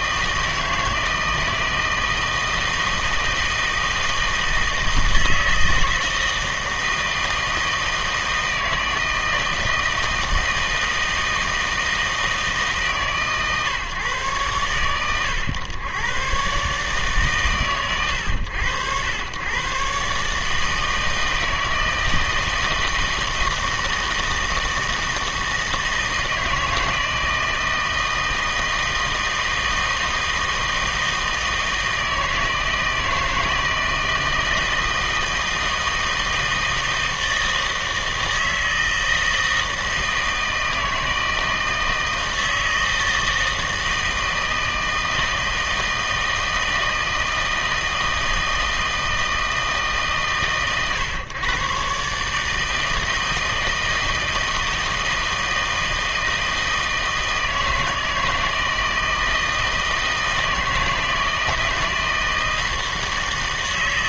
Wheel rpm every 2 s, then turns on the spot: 160, 160, 160, 160, 160, 160, 150, 120, 140, 90, 150, 160, 160, 160, 160, 160, 160, 160, 160, 160, 160, 160, 160, 160, 160, 130, 160, 160, 160, 160, 160, 160.
none